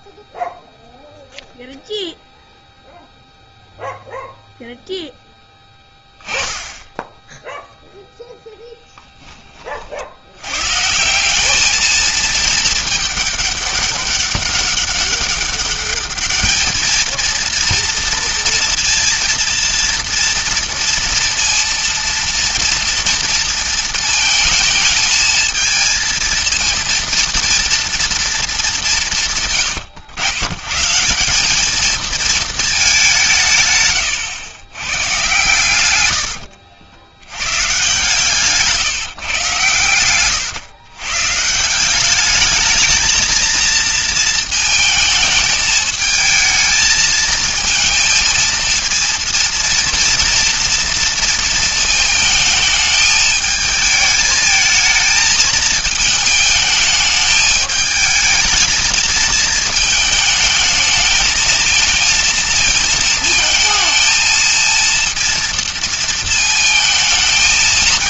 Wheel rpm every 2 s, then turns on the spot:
0, 0, 0, 10, 10, 130, 220, 200, 220, 230, 230, 230, 220, 230, 190, 140, 210, 110, 70, 150, 120, 220, 220, 220, 230, 230, 220, 220, 210, 220, 220, 230, 230, 220.
none